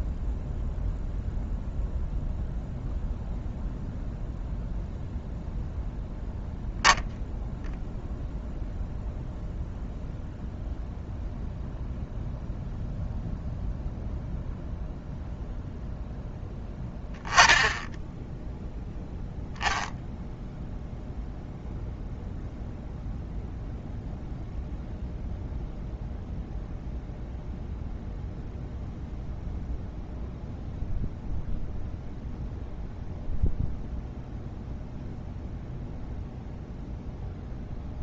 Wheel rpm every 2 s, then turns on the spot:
0, 0, 0, 0, 0, 0, 0, 0, 10, 0, 0, 0, 0, 0, 0, 0, 0, 0, 0.
none